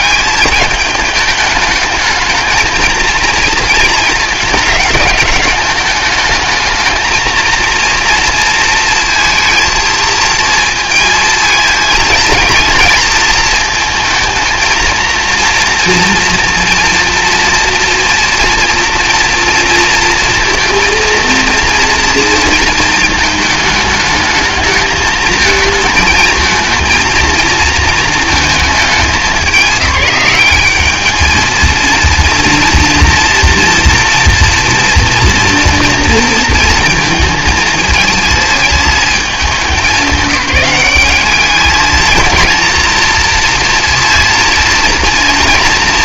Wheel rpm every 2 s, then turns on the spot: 210, 220, 210, 220, 230, 230, 230, 230, 230, 230, 230, 230, 220, 220, 220, 210, 230, 230, 230, 220, 200, 230, 230.
none